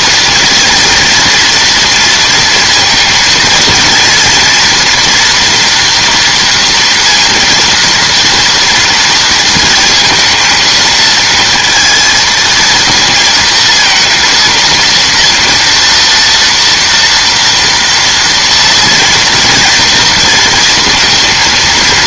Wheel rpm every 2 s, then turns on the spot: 230, 230, 230, 230, 230, 220, 220, 230, 230, 230, 230.
none